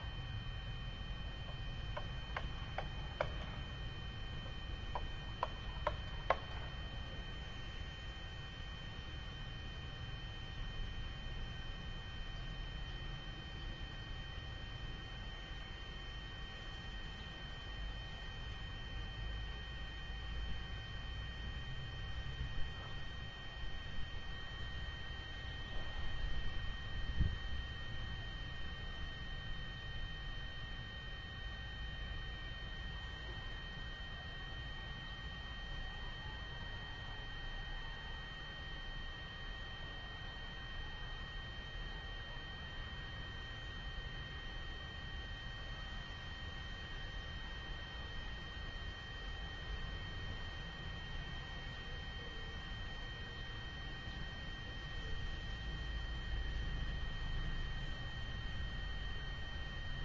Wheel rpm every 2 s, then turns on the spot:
0, 0, 0, 0, 0, 0, 0, 0, 0, 0, 0, 0, 0, 0, 0, 0, 0, 0, 0, 0, 0, 0, 0, 0, 0, 0, 0, 0, 0, 0.
none